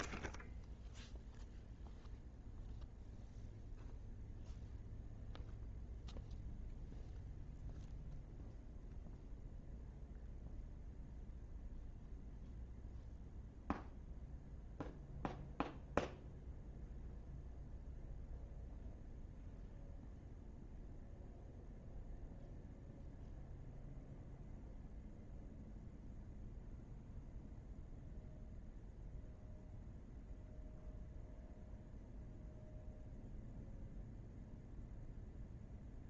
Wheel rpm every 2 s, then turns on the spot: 0, 0, 0, 0, 0, 0, 0, 0, 0, 0, 0, 0, 0, 0, 0, 0, 0, 0.
none